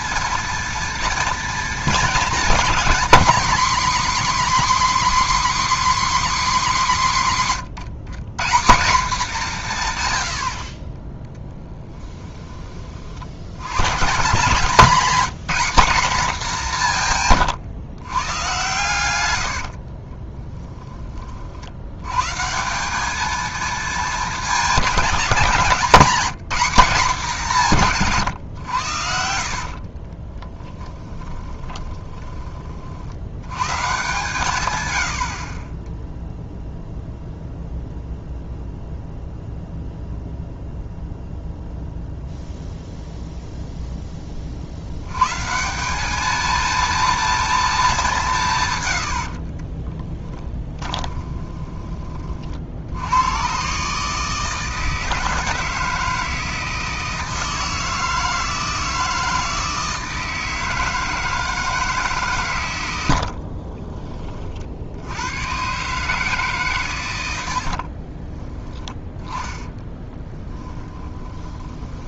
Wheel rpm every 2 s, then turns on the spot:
230, 230, 290, 250, 180, 50, 20, 180, 190, 120, 10, 170, 210, 200, 110, 10, 30, 120, 0, 0, 0, 0, 50, 220, 130, 20, 60, 160, 160, 160, 160, 120, 50, 140, 10, 10.
10-12 30-32 48-52 70-72